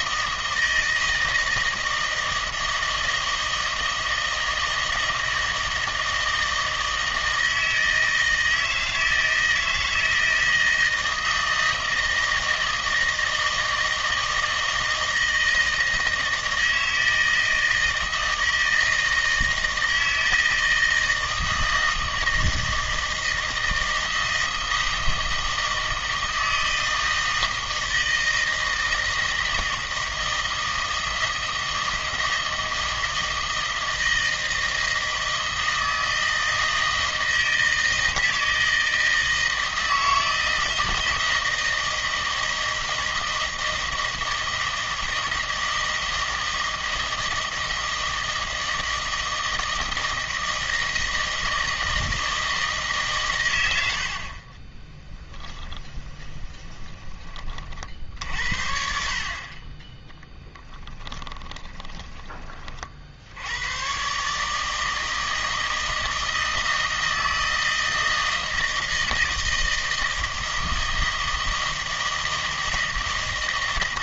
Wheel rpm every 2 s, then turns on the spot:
160, 160, 160, 160, 160, 160, 160, 160, 160, 160, 160, 160, 160, 160, 160, 160, 160, 160, 160, 160, 160, 160, 160, 160, 160, 160, 160, 30, 20, 50, 20, 40, 150, 160, 160, 160, 160.
54-58 60-62